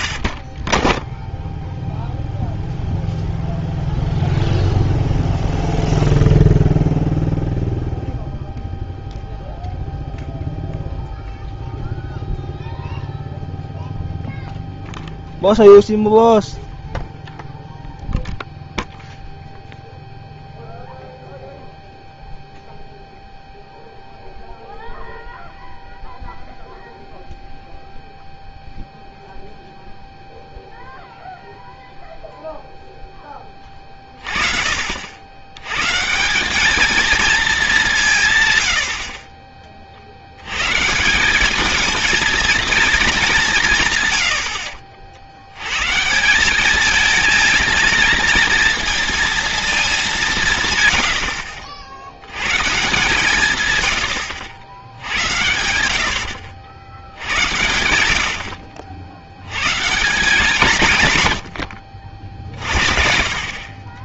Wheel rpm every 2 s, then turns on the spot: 10, 0, 0, 0, 0, 0, 0, 0, 0, 0, 0, 0, 0, 0, 0, 0, 0, 50, 220, 110, 140, 230, 60, 210, 230, 110, 150, 90, 90, 60, 140, 50.
0-2 50-52